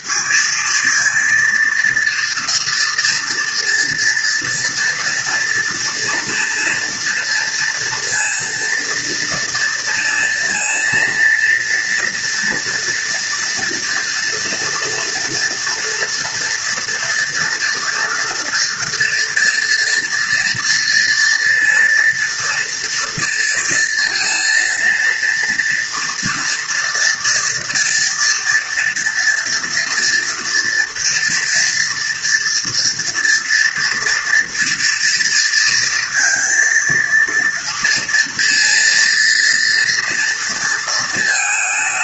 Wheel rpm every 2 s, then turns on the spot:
230, 230, 230, 230, 230, 240, 230, 230, 230, 240, 230, 230, 230, 230, 230, 230, 230, 230, 230, 230, 230.
none